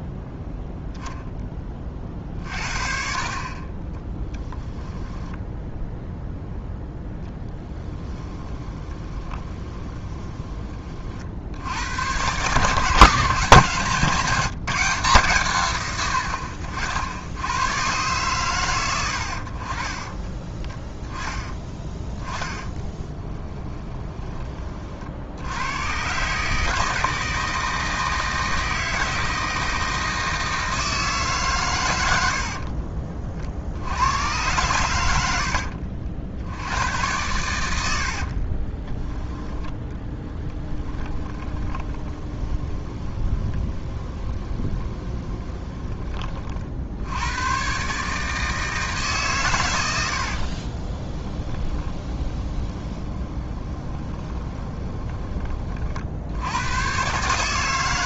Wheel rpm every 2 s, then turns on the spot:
0, 50, 10, 0, 20, 40, 150, 160, 60, 100, 20, 20, 40, 160, 160, 160, 50, 100, 100, 30, 10, 20, 20, 70, 150, 30, 20, 20, 120.
4-6 8-10 22-24 32-34 38-46 50-54